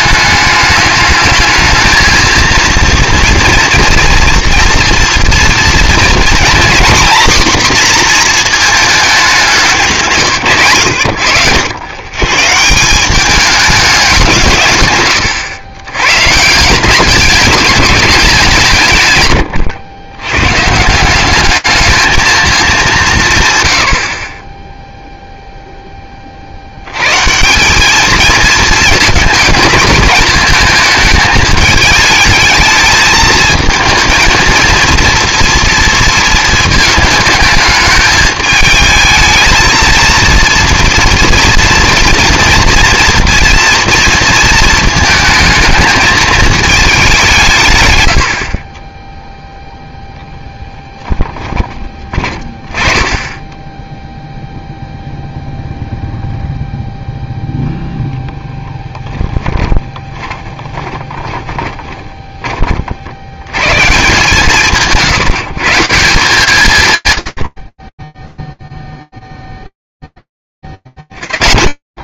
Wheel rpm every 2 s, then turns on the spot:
210, 230, 230, 250, 220, 110, 170, 120, 180, 160, 160, 200, 0, 90, 220, 220, 220, 230, 220, 220, 230, 230, 230, 210, 20, 20, 20, 0, 0, 10, 20, 70, 150, 150, 0, 10.
58-62